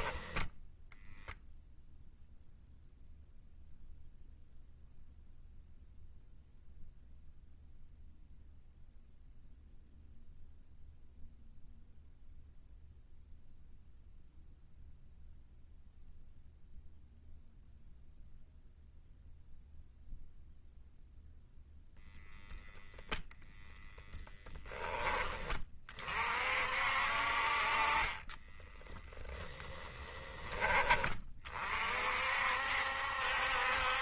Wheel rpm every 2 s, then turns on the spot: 0, 0, 0, 0, 0, 0, 0, 0, 0, 0, 0, 0, 10, 50, 10, 20, 60.
28-30